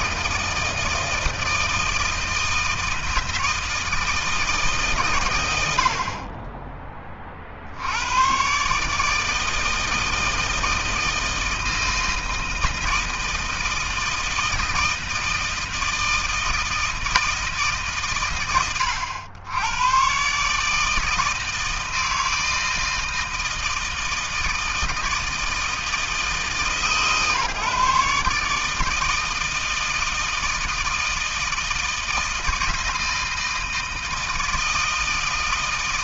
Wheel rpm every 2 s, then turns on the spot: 160, 160, 120, 20, 150, 160, 160, 160, 160, 90, 160, 160, 160, 140, 160, 160, 160, 160.
none